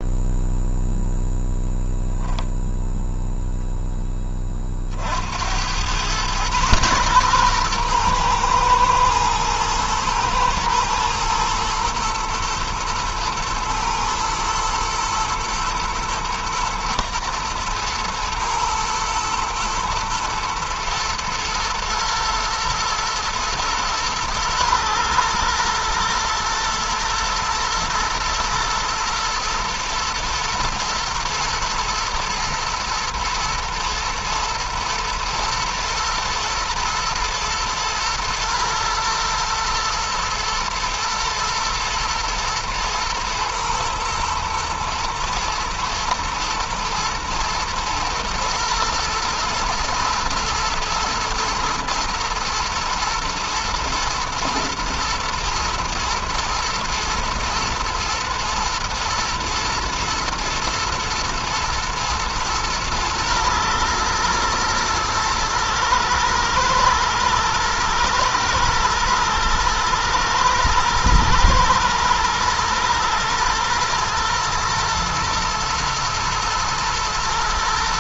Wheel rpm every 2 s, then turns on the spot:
0, 0, 40, 120, 120, 110, 110, 120, 120, 110, 110, 110, 110, 110, 110, 120, 120, 110, 110, 120, 110, 120, 120, 110, 110, 110, 110, 110, 110, 120, 110, 120, 110, 110, 110, 110, 110, 110, 110.
none